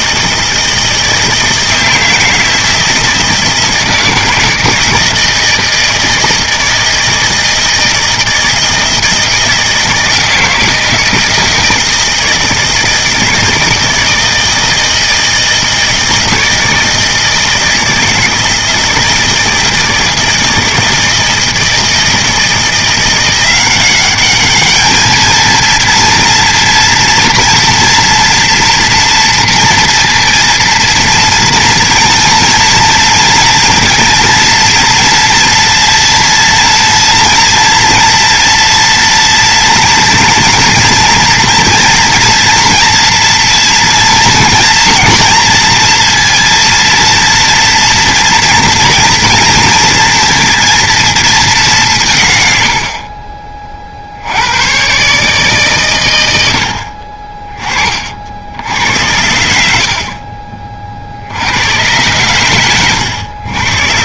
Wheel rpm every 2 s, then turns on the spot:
160, 160, 160, 160, 160, 160, 160, 160, 160, 160, 160, 170, 210, 230, 230, 230, 230, 230, 230, 230, 230, 230, 240, 230, 230, 230, 80, 120, 80, 80, 40, 110.
52-54